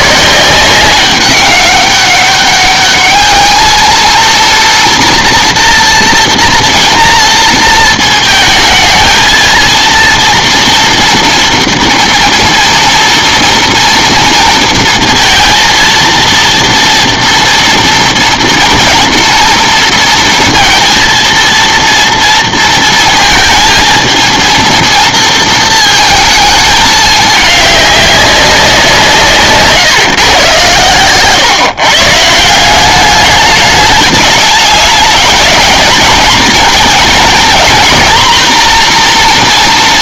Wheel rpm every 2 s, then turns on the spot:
180, 200, 240, 230, 230, 230, 230, 230, 230, 230, 230, 230, 230, 220, 190, 120, 170, 210, 230, 240.
none